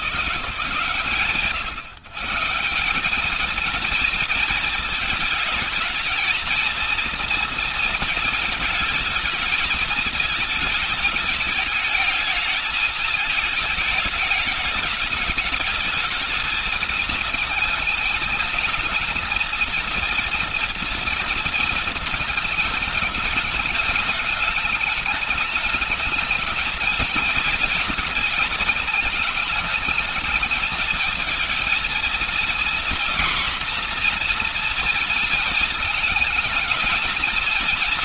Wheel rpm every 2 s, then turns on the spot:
150, 190, 220, 230, 220, 220, 220, 210, 220, 230, 230, 210, 210, 230, 220, 220, 240, 240, 220.
none